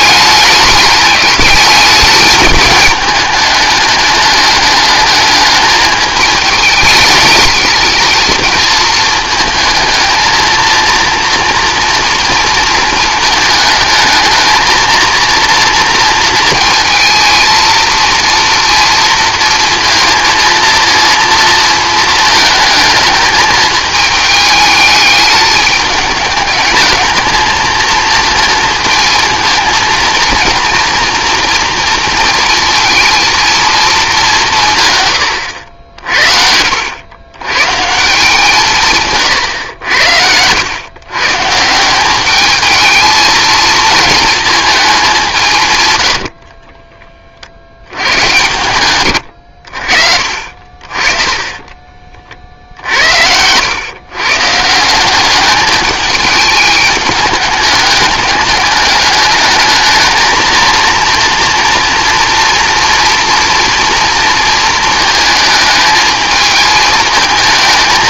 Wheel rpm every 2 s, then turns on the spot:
210, 210, 210, 210, 220, 230, 230, 230, 230, 230, 230, 220, 210, 210, 220, 240, 230, 140, 90, 150, 120, 220, 200, 20, 110, 40, 70, 170, 210, 210, 230, 230, 220, 220.
34-36 50-52